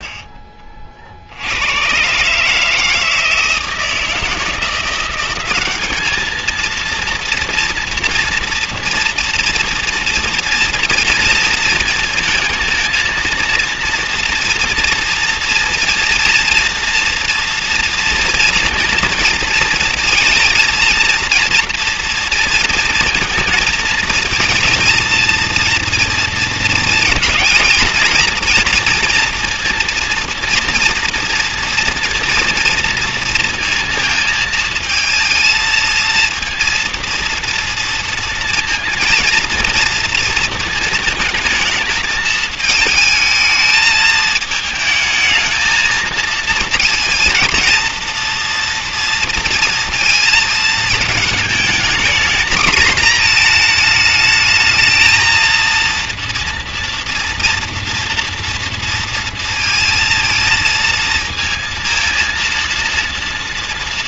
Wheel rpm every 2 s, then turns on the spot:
30, 150, 170, 230, 240, 230, 220, 230, 230, 230, 230, 230, 230, 230, 230, 230, 230, 220, 230, 230, 220, 220, 220, 230, 230, 220, 230, 220, 230, 230, 230, 230.
none